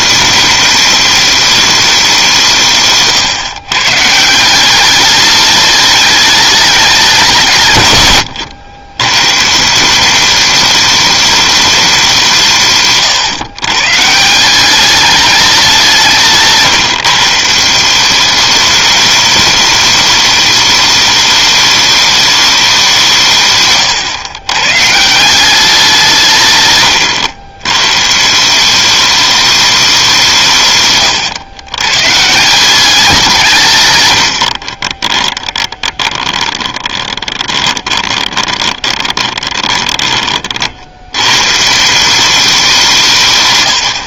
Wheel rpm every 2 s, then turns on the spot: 210, 150, 190, 210, 110, 210, 140, 190, 150, 210, 210, 190, 130, 130, 190, 150, 180, 40, 20, 20, 60, 160.
34-40